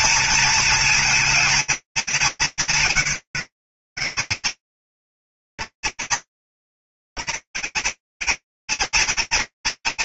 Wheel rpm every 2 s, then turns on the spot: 230, 210, 200, 230, 240.
none